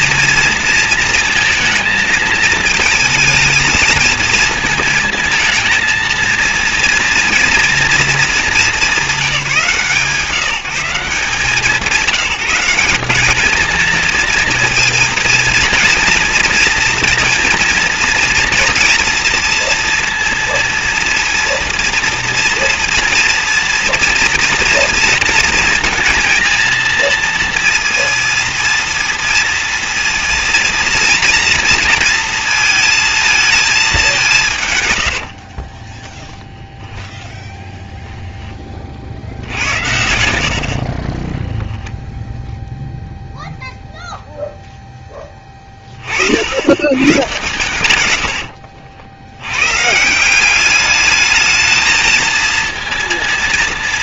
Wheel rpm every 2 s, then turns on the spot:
230, 220, 220, 230, 220, 160, 190, 230, 230, 230, 230, 240, 240, 230, 230, 230, 230, 150, 20, 10, 70, 10, 0, 70, 80, 190, 230.
36-38 40-42 48-50